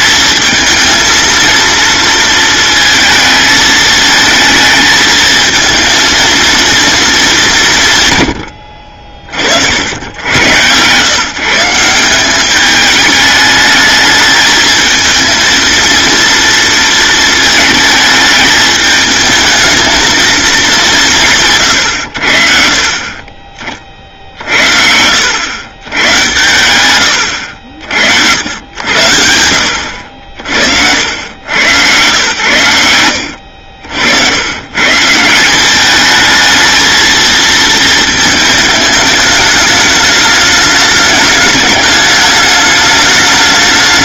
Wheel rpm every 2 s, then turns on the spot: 220, 220, 220, 220, 50, 120, 210, 220, 230, 220, 190, 40, 70, 110, 80, 80, 100, 150, 220, 210, 210, 210.
none